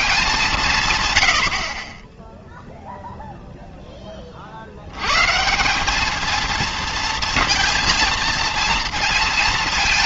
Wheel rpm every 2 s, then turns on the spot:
180, 0, 50, 230, 230.
none